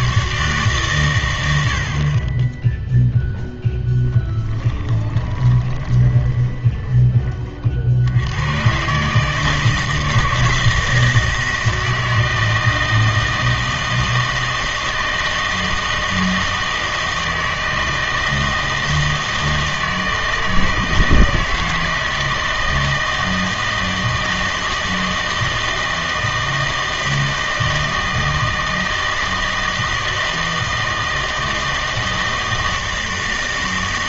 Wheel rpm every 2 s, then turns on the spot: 140, 10, 20, 20, 130, 160, 160, 160, 160, 160, 160, 160, 160, 160, 160, 160, 160.
4-8